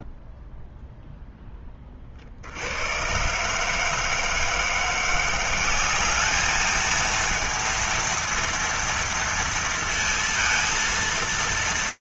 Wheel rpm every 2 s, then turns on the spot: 0, 30, 160, 200, 230, 230.
none